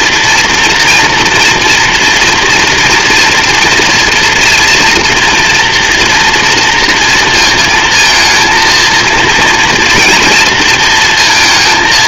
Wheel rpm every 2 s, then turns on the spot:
230, 230, 240, 230, 230, 230.
none